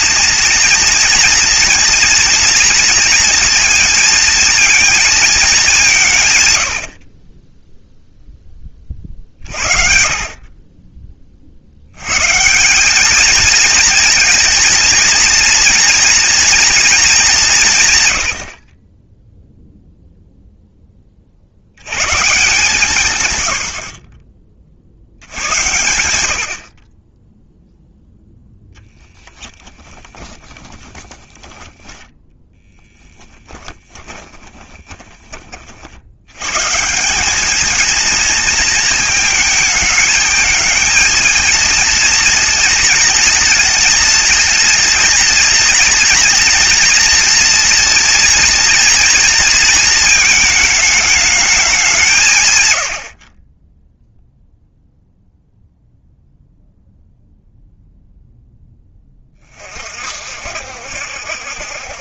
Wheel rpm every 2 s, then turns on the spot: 230, 230, 230, 120, 20, 30, 160, 230, 230, 50, 10, 170, 40, 80, 0, 20, 10, 20, 130, 230, 220, 230, 220, 230, 230, 220, 120, 0, 0, 10, 60.
10-12 30-32 34-36